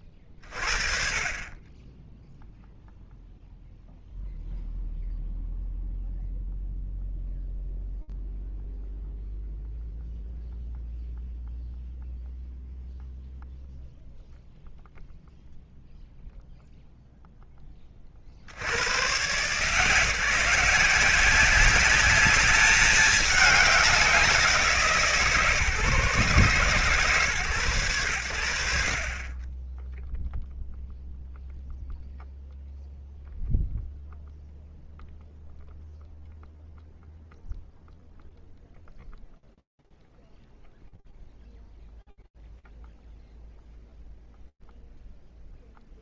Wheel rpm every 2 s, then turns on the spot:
30, 0, 0, 0, 0, 0, 0, 0, 0, 40, 170, 210, 190, 140, 90, 0, 0, 0, 0, 0, 0, 0, 0.
none